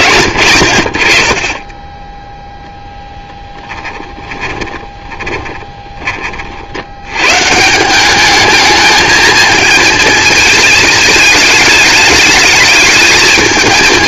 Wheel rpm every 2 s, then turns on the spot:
60, 10, 20, 60, 220, 220, 220.
4-6